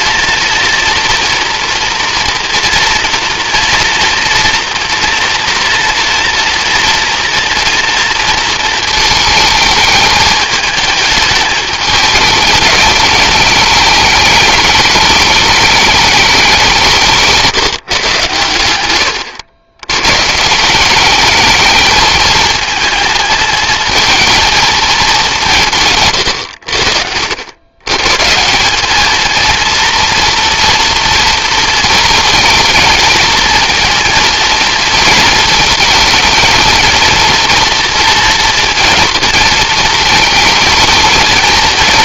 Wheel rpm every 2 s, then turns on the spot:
230, 230, 240, 230, 220, 210, 210, 210, 180, 110, 160, 220, 230, 90, 190, 230, 220, 230, 220, 230, 220.
none